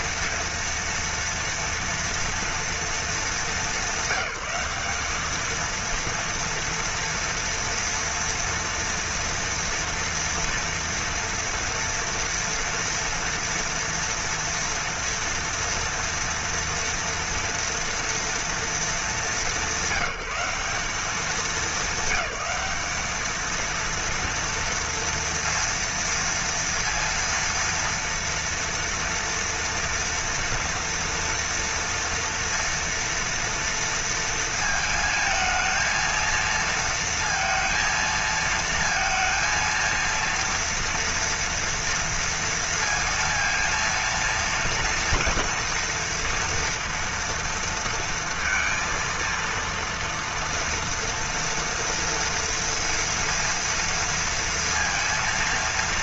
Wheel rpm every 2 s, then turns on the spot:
230, 230, 200, 230, 230, 230, 230, 230, 240, 230, 190, 210, 230, 230, 230, 230, 230, 230, 230, 220, 230, 230, 230, 230, 230, 230, 240, 230.
none